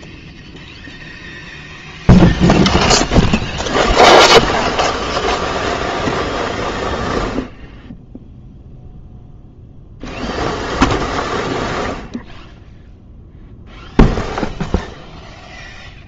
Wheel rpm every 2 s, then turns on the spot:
0, 0, 0, 0, 0, 0, 0, 0.
none